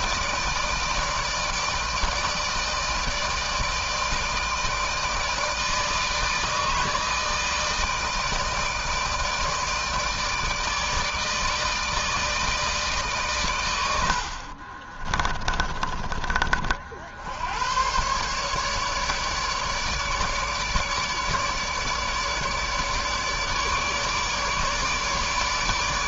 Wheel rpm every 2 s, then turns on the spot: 160, 160, 160, 160, 160, 160, 120, 20, 80, 150, 150, 150, 150.
14-16